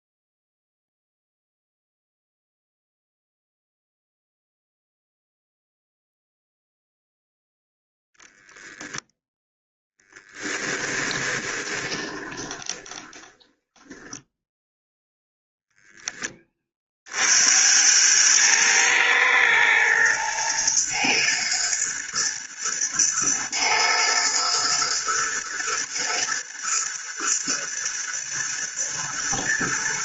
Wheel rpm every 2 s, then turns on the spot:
0, 0, 0, 0, 0, 20, 20, 0, 50, 110, 120, 110, 120, 110, 120.
10-14